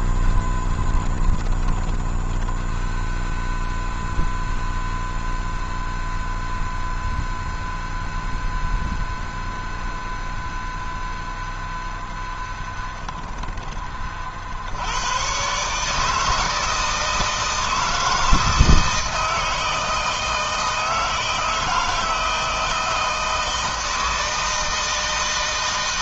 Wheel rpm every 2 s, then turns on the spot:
40, 10, 0, 0, 0, 0, 0, 40, 160, 160, 160, 160, 160.
2-4